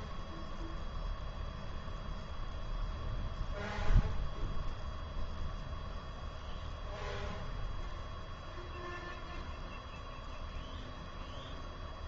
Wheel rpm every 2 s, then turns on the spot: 0, 0, 0, 0, 0, 0.
none